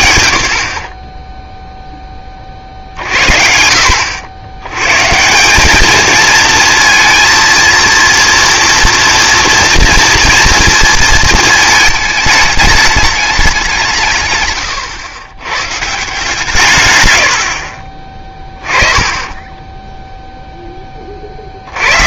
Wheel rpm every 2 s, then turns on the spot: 80, 30, 80, 230, 230, 230, 210, 120, 180, 30, 10.
none